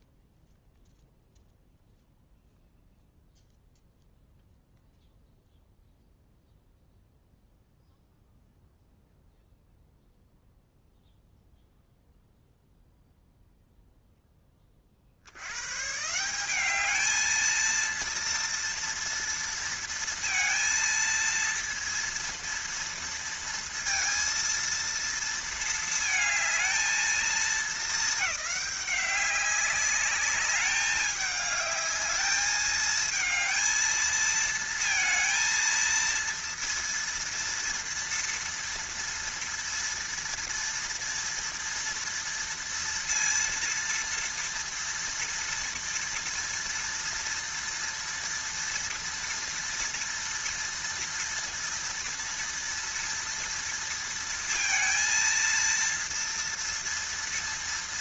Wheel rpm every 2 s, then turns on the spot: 0, 0, 0, 0, 0, 0, 0, 20, 200, 230, 230, 230, 230, 220, 200, 200, 220, 220, 230, 230, 230, 230, 230, 230, 230, 230, 230, 230, 230.
none